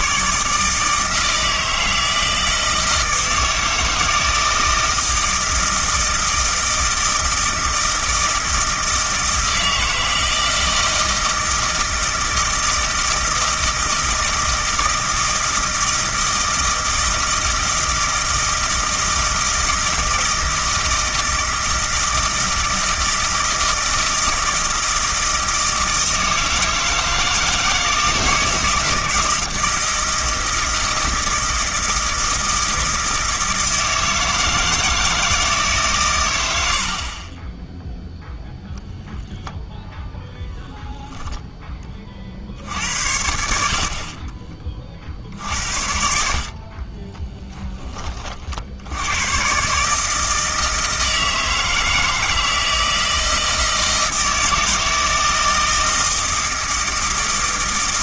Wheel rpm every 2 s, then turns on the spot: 150, 160, 160, 160, 160, 160, 160, 160, 160, 160, 160, 160, 160, 160, 170, 160, 160, 160, 70, 0, 10, 70, 40, 40, 70, 160, 160, 160, 160.
none